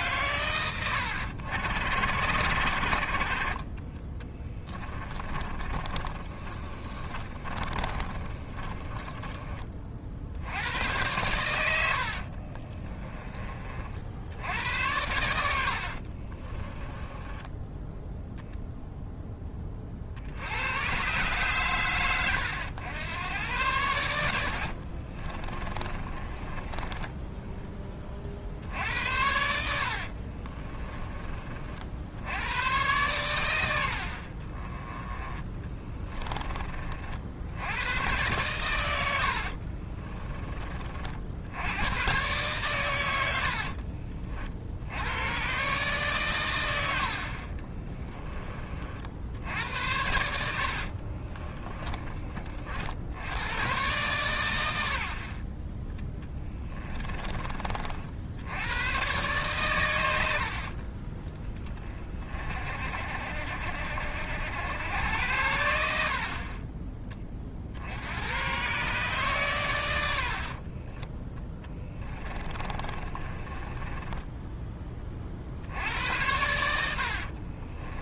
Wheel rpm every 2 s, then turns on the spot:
90, 50, 20, 30, 20, 100, 20, 90, 20, 0, 110, 100, 50, 10, 70, 30, 100, 20, 40, 110, 40, 120, 80, 80, 50, 50, 60, 90, 30, 100, 30, 40, 90, 20, 130, 30, 30, 20, 70.
4-10 12-14 16-18 24-28 30-32 46-48 50-52 56-58 70-74 76-78